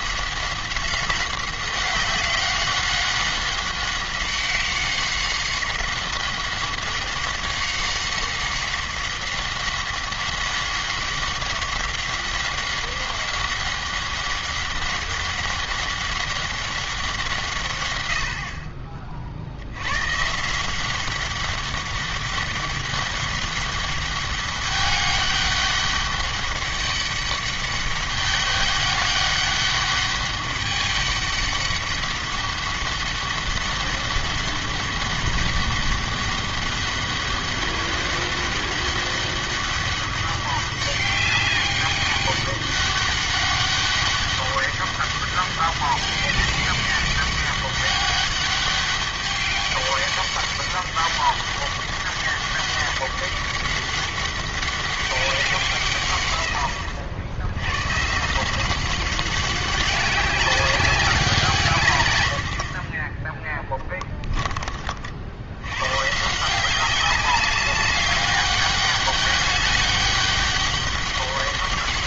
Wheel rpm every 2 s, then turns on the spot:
190, 190, 190, 190, 190, 190, 190, 190, 190, 40, 180, 200, 200, 200, 200, 200, 200, 200, 200, 200, 200, 200, 200, 200, 200, 200, 200, 200, 100, 190, 190, 40, 40, 190, 200, 200.
none